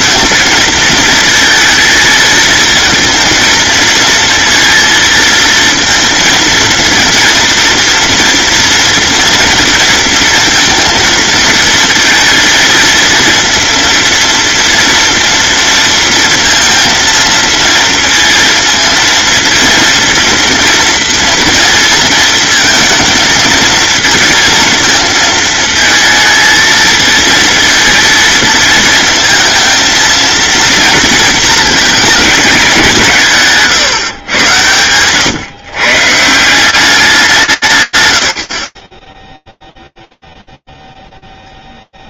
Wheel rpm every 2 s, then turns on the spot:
230, 230, 230, 230, 230, 230, 230, 230, 230, 220, 230, 230, 230, 220, 220, 230, 190, 100, 180, 50, 0.
none